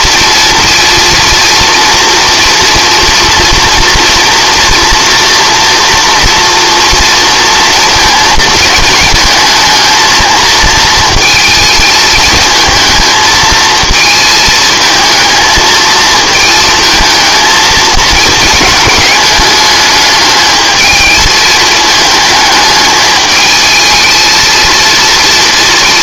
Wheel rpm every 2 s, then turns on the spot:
240, 230, 230, 230, 220, 230, 220, 220, 220, 220, 220, 210, 220.
none